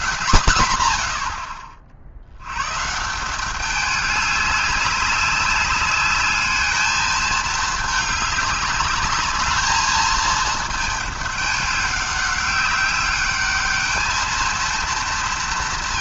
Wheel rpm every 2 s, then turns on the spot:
120, 130, 200, 220, 200, 220, 200, 230.
none